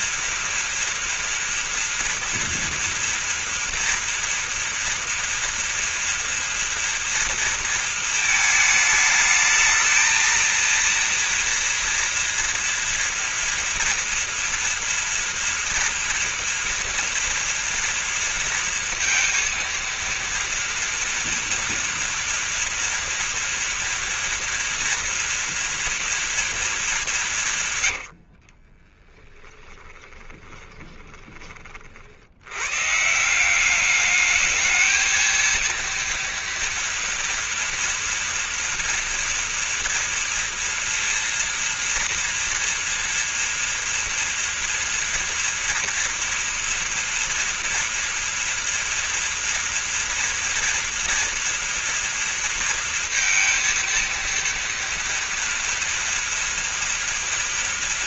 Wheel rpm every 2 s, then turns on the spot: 230, 230, 230, 230, 210, 230, 230, 230, 230, 230, 230, 230, 230, 220, 40, 20, 120, 220, 230, 230, 230, 230, 230, 230, 230, 230, 230, 230, 230.
28-32